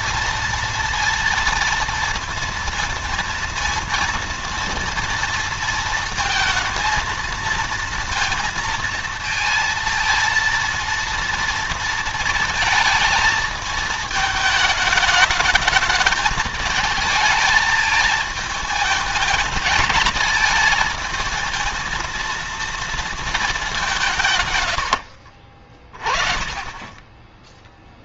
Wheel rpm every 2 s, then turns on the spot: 230, 230, 240, 230, 230, 230, 230, 220, 220, 220, 220, 230, 120, 30.
none